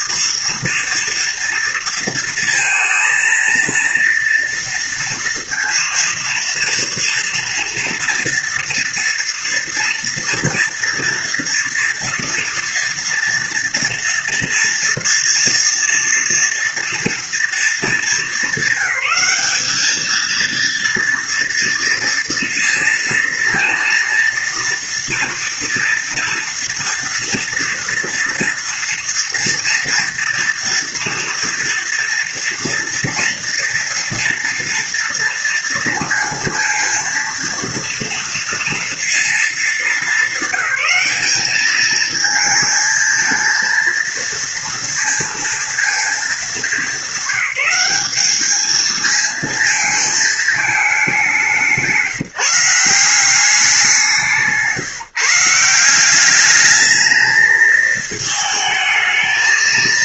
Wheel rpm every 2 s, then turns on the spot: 230, 230, 230, 230, 230, 230, 230, 230, 240, 220, 230, 230, 230, 230, 230, 230, 230, 230, 230, 230, 210, 220, 230, 210, 220, 210, 180, 160, 210, 220.
none